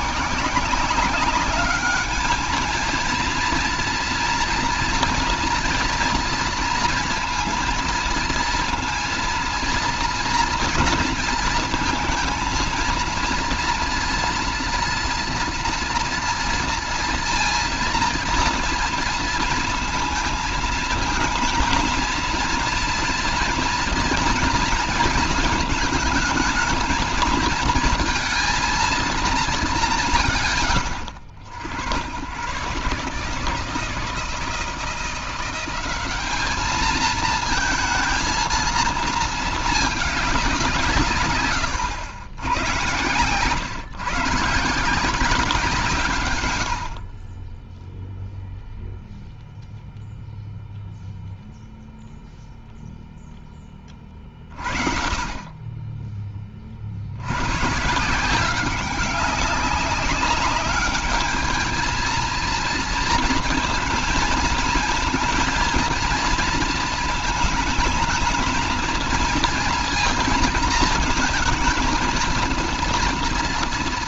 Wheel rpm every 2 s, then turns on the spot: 160, 220, 230, 230, 230, 230, 230, 230, 230, 240, 220, 230, 230, 220, 230, 130, 100, 170, 210, 230, 190, 100, 140, 110, 0, 0, 0, 50, 30, 180, 200, 230, 220, 230, 230, 230, 230.
none